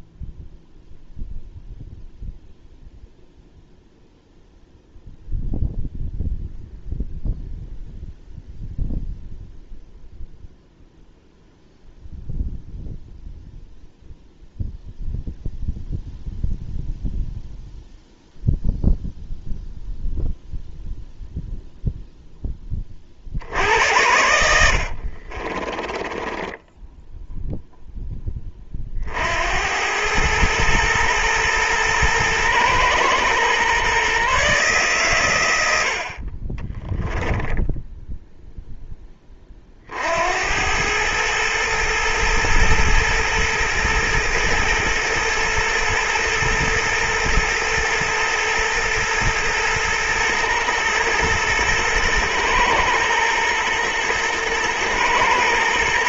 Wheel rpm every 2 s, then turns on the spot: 0, 0, 0, 0, 0, 0, 0, 0, 0, 0, 0, 40, 60, 10, 40, 110, 110, 130, 10, 10, 100, 120, 120, 120, 120, 110, 110, 110.
24-28 36-38